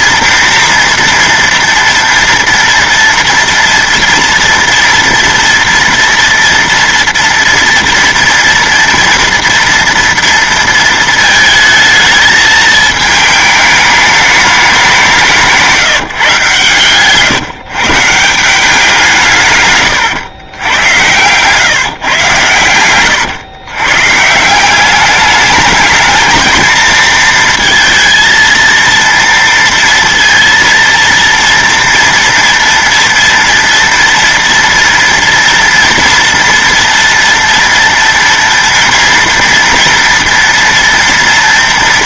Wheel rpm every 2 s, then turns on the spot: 230, 230, 230, 230, 230, 230, 220, 210, 140, 170, 100, 110, 170, 220, 230, 230, 230, 230, 240, 230, 230.
none